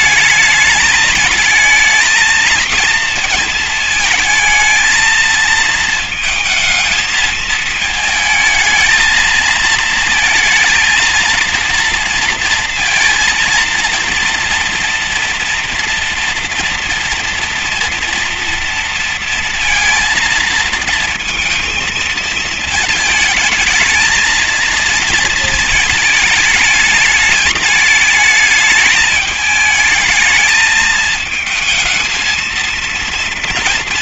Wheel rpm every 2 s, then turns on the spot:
220, 230, 220, 220, 230, 230, 230, 230, 230, 230, 230, 220, 230, 210, 220, 220, 230.
none